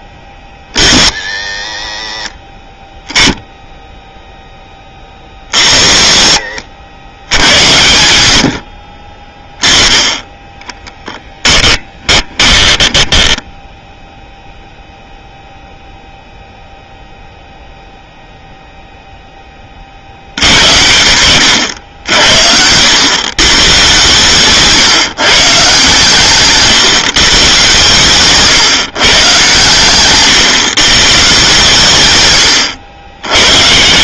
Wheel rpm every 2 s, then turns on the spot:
50, 40, 10, 60, 70, 10, 20, 0, 0, 0, 80, 80, 140, 140, 130, 130, 110.
6-8 10-14